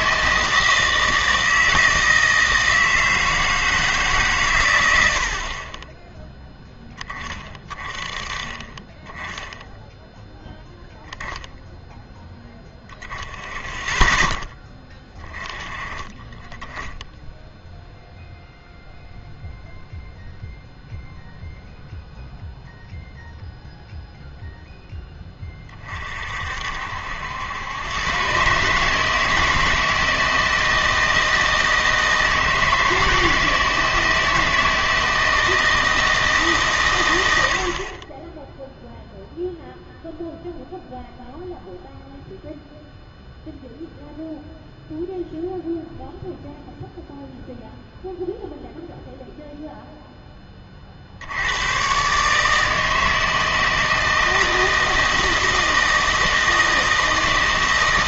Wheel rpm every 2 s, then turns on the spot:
160, 160, 110, 10, 20, 10, 10, 10, 20, 0, 0, 0, 0, 60, 140, 160, 160, 160, 130, 0, 0, 0, 0, 0, 0, 30, 160, 160, 160.
none